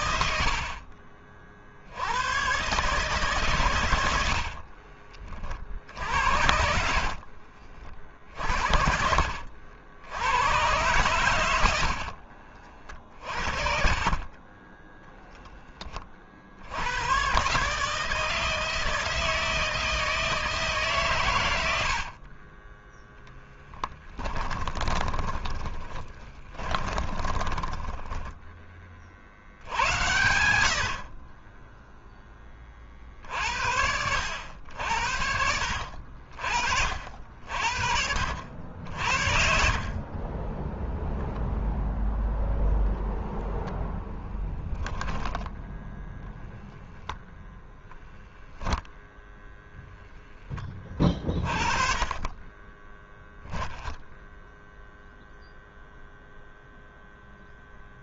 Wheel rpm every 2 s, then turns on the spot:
50, 140, 40, 50, 60, 110, 40, 0, 90, 160, 140, 10, 20, 30, 50, 50, 50, 80, 60, 60, 0, 0, 10, 0, 0, 20, 10, 0, 0.
4-8 10-14 24-28